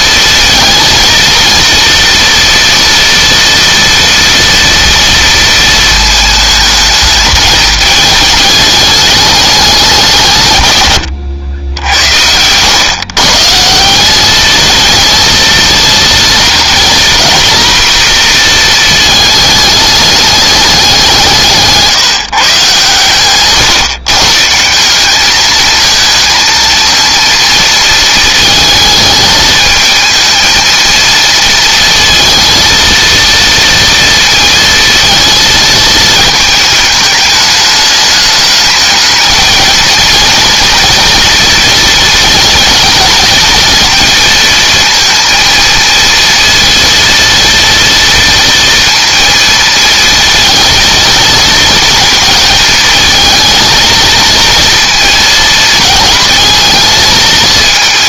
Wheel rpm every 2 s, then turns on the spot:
230, 240, 230, 220, 210, 140, 110, 220, 230, 230, 200, 140, 150, 230, 220, 230, 230, 230, 220, 210, 230, 220, 230, 230, 230, 220, 220, 230, 230.
none